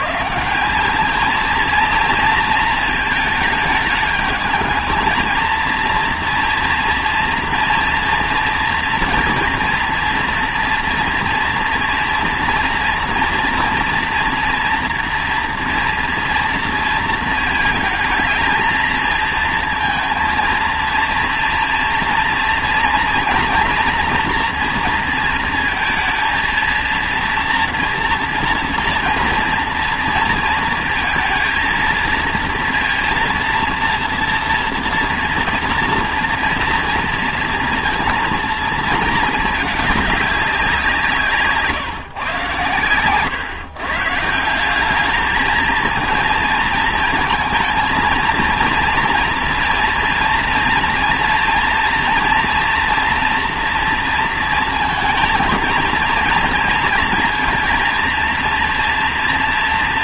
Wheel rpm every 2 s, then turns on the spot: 180, 220, 220, 230, 230, 230, 230, 230, 230, 220, 230, 240, 230, 230, 230, 230, 230, 230, 230, 230, 190, 120, 180, 220, 230, 230, 240, 230, 230, 230.
none